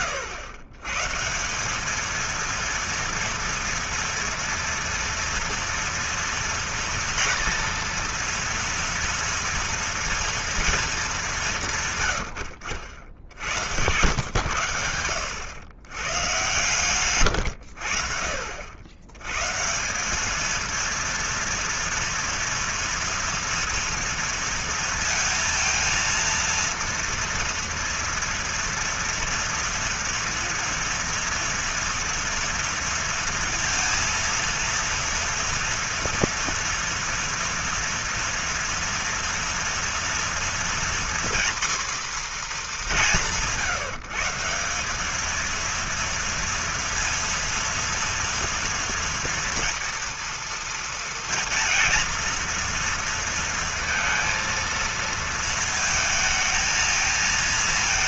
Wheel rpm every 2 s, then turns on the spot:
110, 230, 230, 230, 230, 220, 80, 100, 120, 90, 230, 230, 230, 230, 230, 230, 230, 230, 230, 230, 240, 200, 200, 230, 240, 230, 230, 230, 220.
none